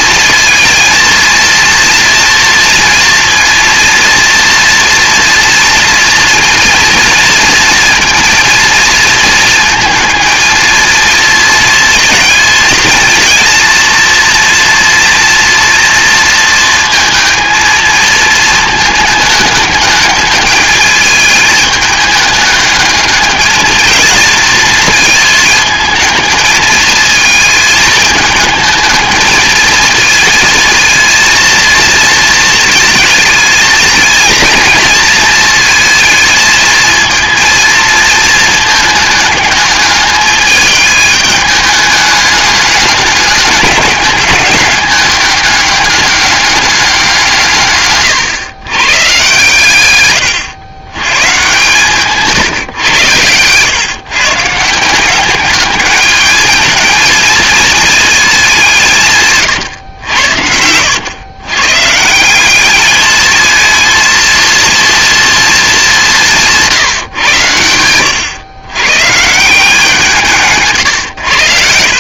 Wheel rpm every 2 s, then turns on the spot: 230, 230, 230, 230, 230, 230, 220, 230, 230, 220, 210, 210, 230, 220, 220, 230, 220, 230, 230, 220, 210, 210, 210, 190, 120, 120, 120, 170, 220, 170, 100, 210, 230, 160, 120, 130.
70-72